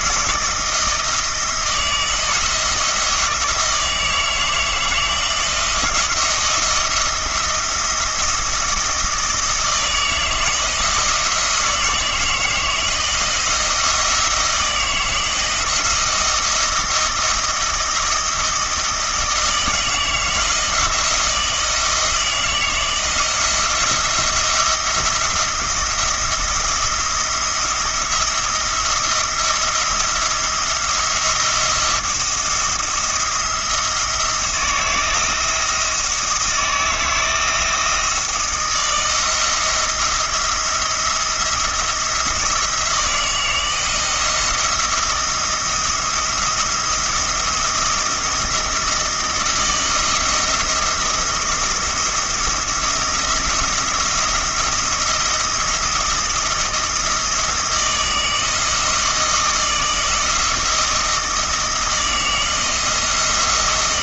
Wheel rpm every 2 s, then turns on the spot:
170, 160, 160, 170, 170, 170, 160, 160, 160, 160, 170, 170, 170, 170, 170, 170, 170, 160, 160, 160, 170, 170, 170, 170, 160, 170, 170, 170, 170, 160, 160, 160.
none